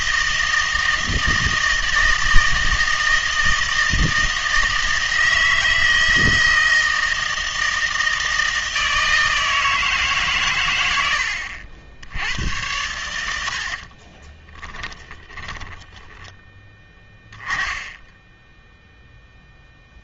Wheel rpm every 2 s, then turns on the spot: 160, 160, 160, 160, 160, 110, 100, 10, 10, 0.
14-16